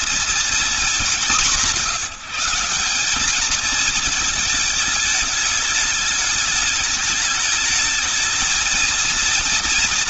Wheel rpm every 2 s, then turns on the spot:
210, 200, 220, 210, 220.
none